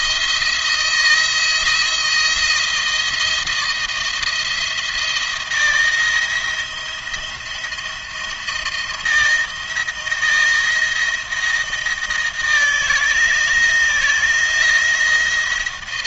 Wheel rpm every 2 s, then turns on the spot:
160, 170, 170, 170, 170, 160, 160, 170.
none